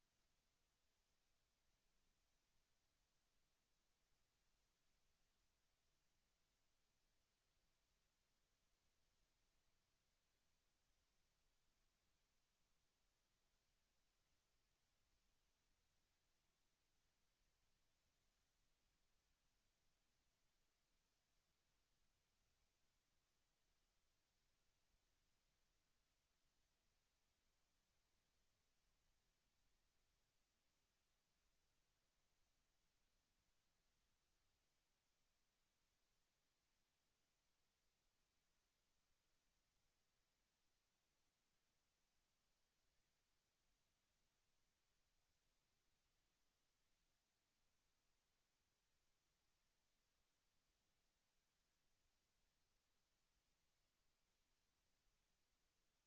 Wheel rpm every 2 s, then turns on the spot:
0, 0, 0, 0, 0, 0, 0, 0, 0, 0, 0, 0, 0, 0, 0, 0, 0, 0, 0, 0, 0, 0, 0, 0, 0, 0, 0, 0.
none